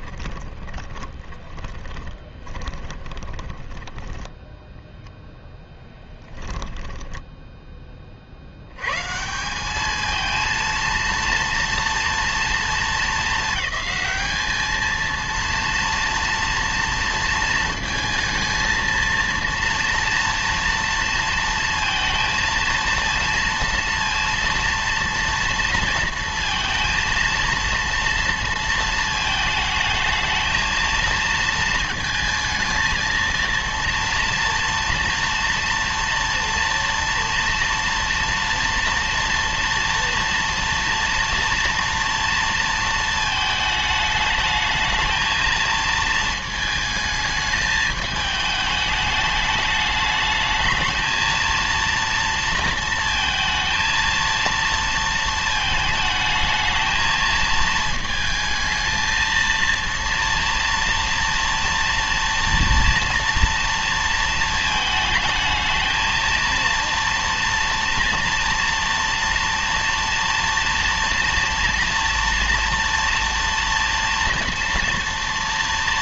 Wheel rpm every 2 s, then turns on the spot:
20, 20, 0, 10, 110, 230, 230, 220, 230, 220, 230, 230, 230, 230, 230, 220, 220, 230, 230, 240, 230, 230, 220, 220, 210, 220, 230, 230, 220, 220, 240, 230, 220, 230, 230, 240, 230, 230.
0-4 6-8